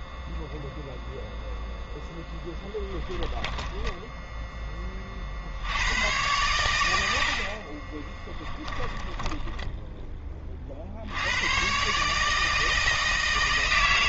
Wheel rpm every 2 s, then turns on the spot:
0, 10, 10, 110, 10, 40, 160.
8-10